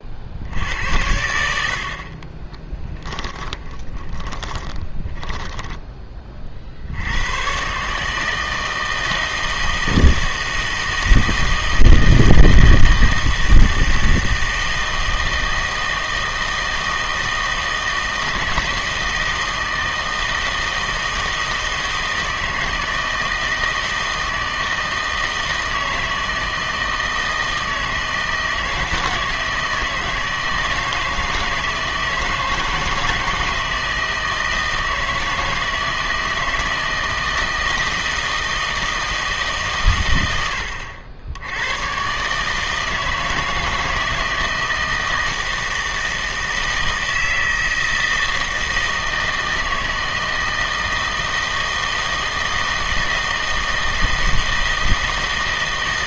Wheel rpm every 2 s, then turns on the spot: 80, 20, 20, 50, 160, 160, 160, 160, 160, 160, 160, 160, 160, 160, 160, 160, 160, 160, 160, 160, 80, 150, 160, 160, 160, 160, 160, 160.
2-6